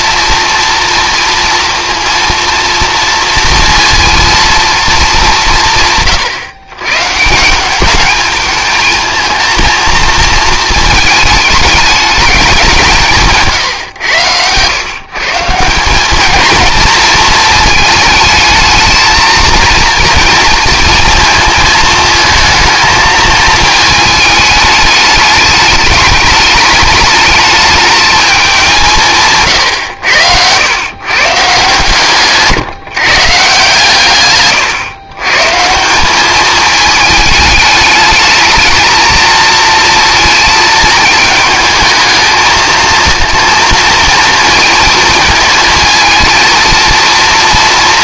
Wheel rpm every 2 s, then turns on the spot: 230, 230, 220, 120, 220, 220, 190, 110, 220, 220, 230, 220, 210, 210, 190, 100, 150, 120, 210, 220, 220, 220, 230, 230.
none